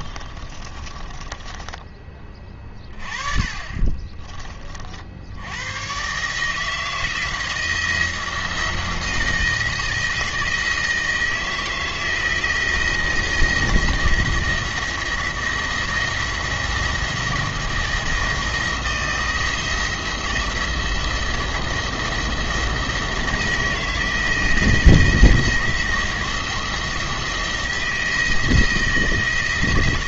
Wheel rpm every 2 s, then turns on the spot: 30, 30, 30, 160, 170, 160, 170, 170, 170, 160, 170, 170, 170, 170, 170.
0-2